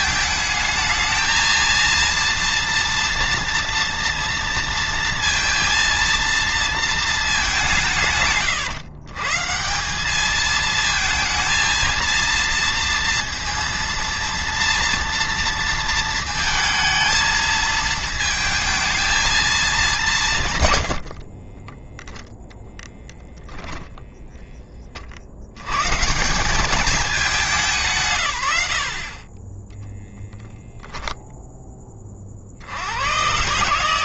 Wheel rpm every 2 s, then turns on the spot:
220, 230, 230, 220, 130, 220, 230, 230, 220, 220, 100, 0, 30, 190, 80, 0, 80.
20-22